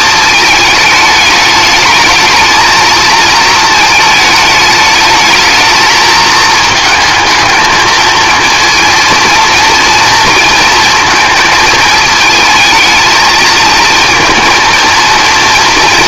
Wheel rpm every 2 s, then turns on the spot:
210, 220, 220, 220, 230, 220, 220, 230.
none